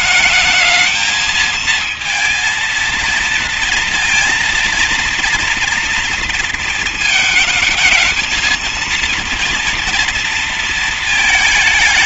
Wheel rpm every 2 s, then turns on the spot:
220, 230, 230, 230, 220, 230.
none